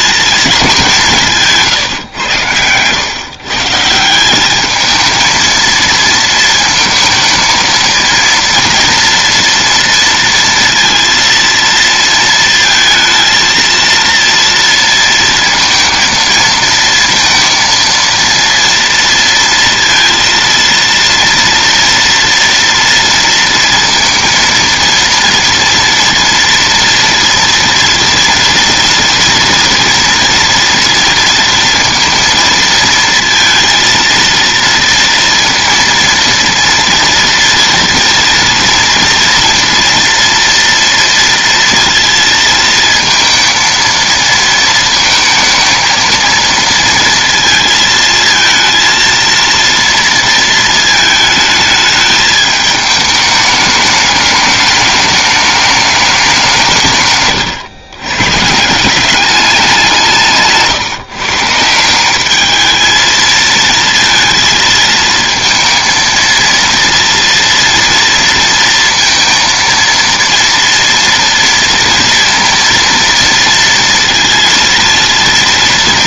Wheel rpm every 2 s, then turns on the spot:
210, 110, 210, 230, 230, 230, 230, 230, 230, 230, 230, 230, 230, 230, 240, 230, 220, 230, 230, 230, 230, 230, 230, 230, 230, 230, 210, 210, 170, 160, 150, 210, 220, 230, 230, 230, 230, 230.
none